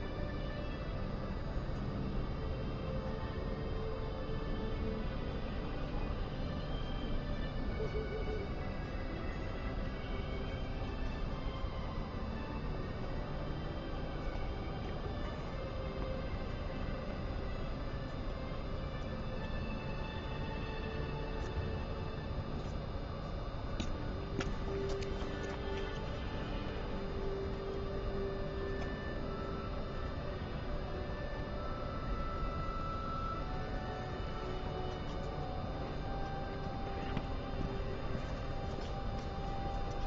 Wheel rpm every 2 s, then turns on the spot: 0, 0, 0, 0, 0, 0, 0, 0, 0, 0, 0, 0, 0, 0, 0, 0, 0, 0, 0, 0.
none